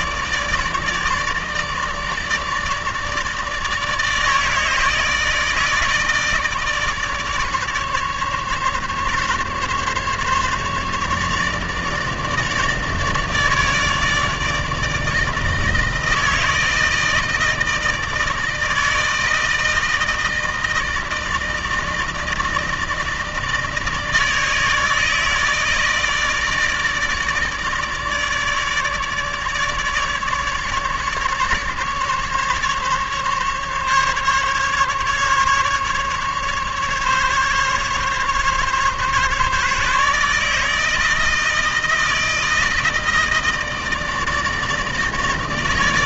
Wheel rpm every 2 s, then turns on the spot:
150, 150, 150, 150, 150, 150, 150, 160, 160, 160, 160, 160, 160, 150, 150, 140, 140, 150, 140, 140, 160, 160, 160.
none